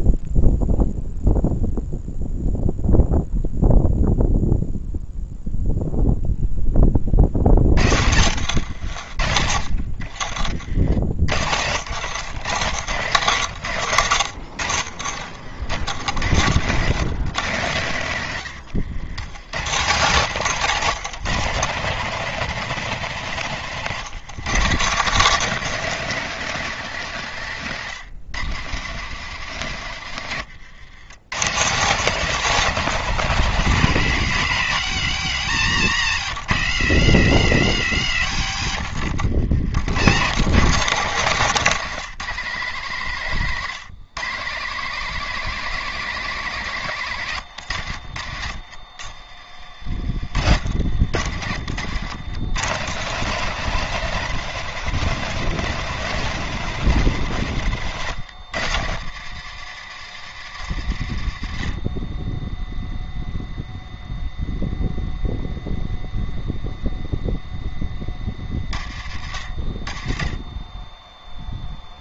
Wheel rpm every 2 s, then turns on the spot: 0, 0, 0, 70, 60, 110, 100, 110, 100, 150, 180, 160, 170, 140, 120, 180, 120, 90, 80, 120, 160, 130, 180, 90, 50, 100, 170, 180, 130, 120, 50, 0, 0, 20, 40, 0.
6-8 28-30 56-58